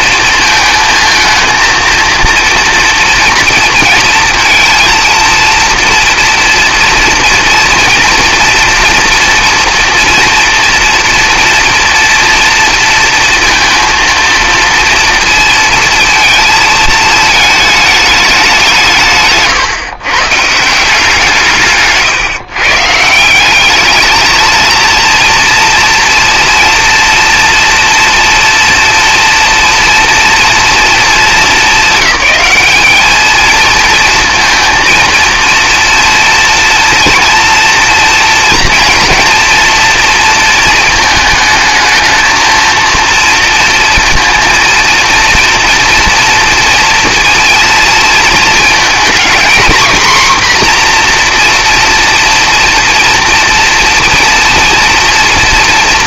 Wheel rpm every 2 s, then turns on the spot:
220, 230, 230, 240, 230, 230, 230, 230, 220, 180, 170, 150, 230, 230, 230, 230, 210, 230, 230, 230, 220, 220, 230, 230, 220, 250, 240, 230.
none